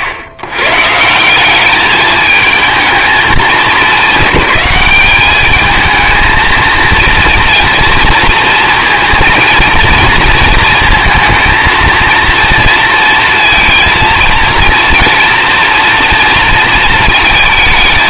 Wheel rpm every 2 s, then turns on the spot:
130, 220, 210, 220, 230, 220, 230, 230, 230.
none